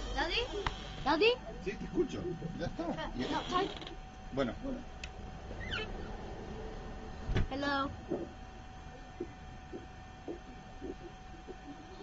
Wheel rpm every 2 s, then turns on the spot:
0, 0, 0, 0, 0, 0.
none